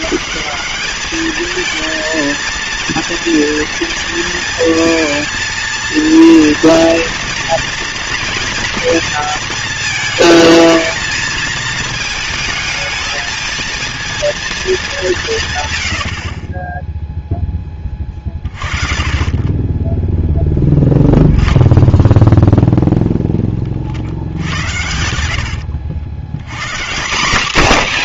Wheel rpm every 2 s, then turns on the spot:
210, 230, 230, 230, 230, 220, 220, 220, 20, 30, 0, 0, 80, 150.
24-26